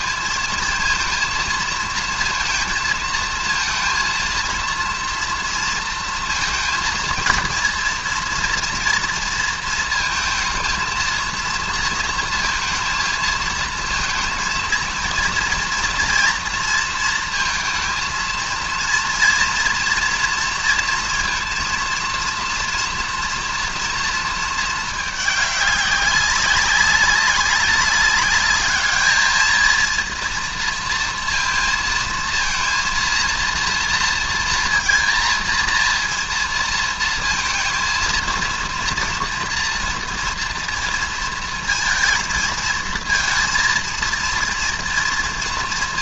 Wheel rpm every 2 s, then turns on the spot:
220, 230, 230, 230, 230, 230, 230, 230, 230, 230, 230, 230, 220, 200, 210, 230, 230, 230, 230, 230, 230, 230, 230.
none